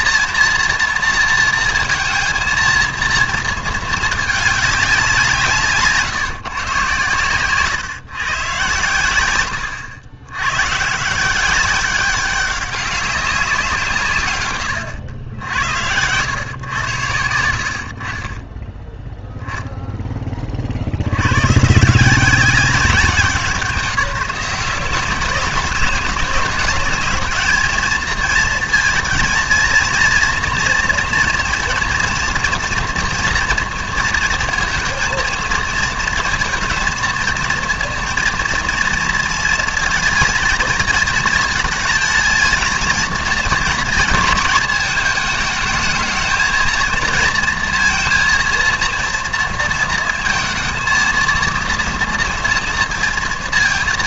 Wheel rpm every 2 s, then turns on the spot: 230, 230, 210, 130, 120, 120, 200, 120, 100, 10, 40, 190, 190, 210, 230, 230, 230, 230, 230, 230, 230, 220, 220, 220, 230, 230, 230.
none